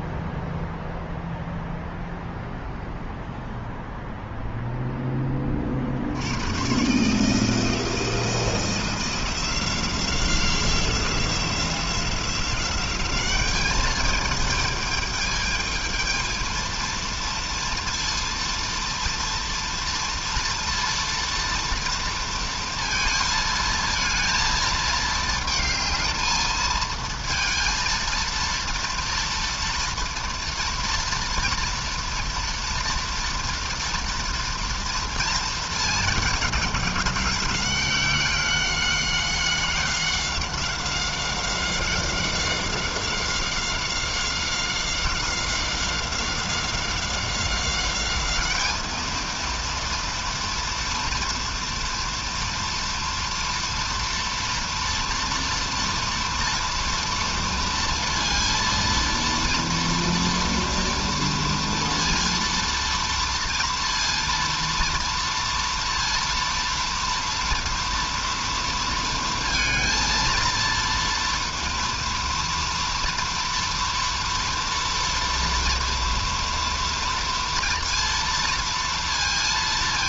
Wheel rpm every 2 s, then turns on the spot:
0, 0, 20, 160, 180, 180, 200, 220, 230, 230, 230, 230, 220, 220, 230, 230, 230, 230, 200, 190, 190, 190, 190, 190, 220, 230, 230, 230, 230, 230, 230, 230, 230, 230, 230, 230, 240, 230, 230, 230.
none